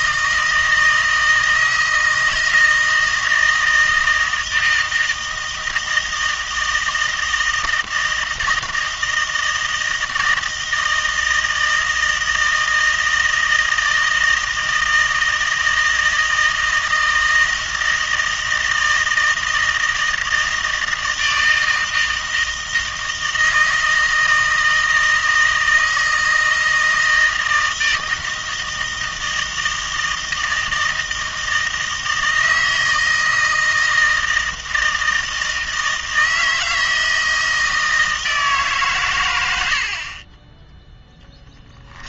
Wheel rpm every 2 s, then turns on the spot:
160, 160, 160, 160, 160, 160, 160, 160, 160, 160, 160, 160, 160, 160, 160, 160, 160, 160, 160, 150, 10.
none